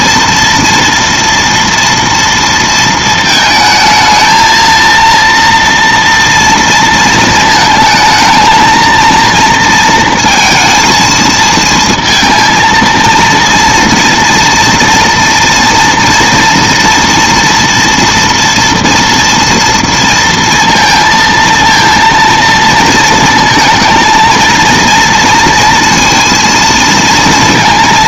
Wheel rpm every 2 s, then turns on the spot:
230, 230, 230, 230, 220, 230, 230, 230, 230, 230, 230, 230, 230, 230.
none